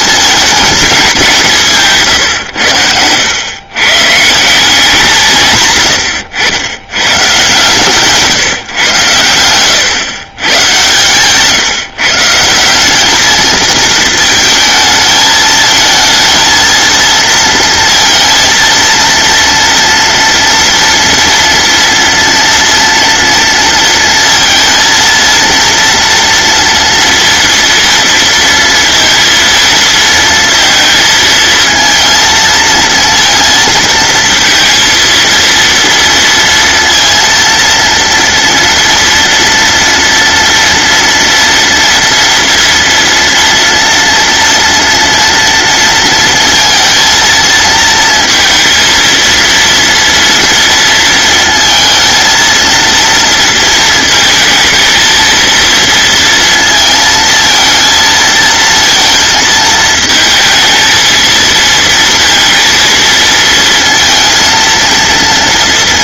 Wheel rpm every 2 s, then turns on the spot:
210, 170, 110, 130, 140, 100, 130, 220, 220, 230, 230, 230, 230, 230, 230, 230, 220, 230, 230, 230, 230, 230, 230, 230, 230, 230, 230, 230, 230, 230, 220, 230, 230.
none